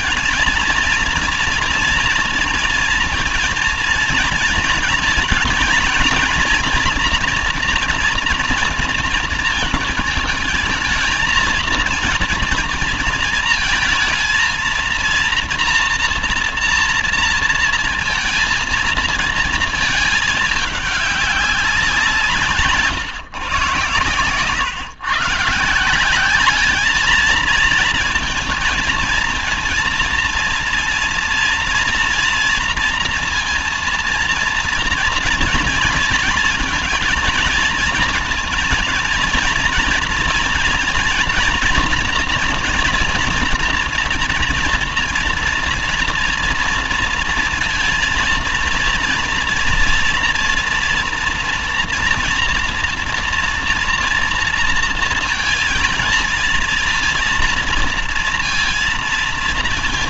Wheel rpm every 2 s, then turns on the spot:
230, 230, 230, 230, 230, 220, 230, 230, 230, 230, 210, 170, 120, 200, 230, 230, 230, 230, 230, 230, 230, 240, 230, 230, 230, 240, 230, 230, 230, 230.
none